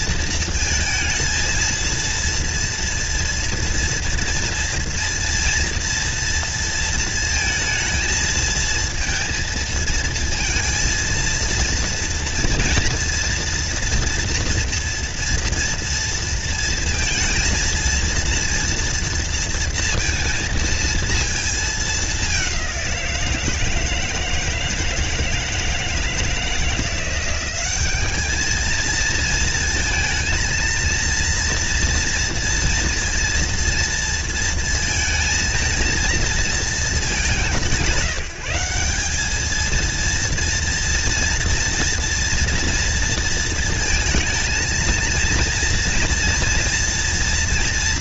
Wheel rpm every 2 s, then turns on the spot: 230, 230, 240, 230, 220, 230, 230, 230, 230, 230, 230, 200, 160, 160, 210, 230, 230, 230, 230, 190, 230, 230, 230, 230.
none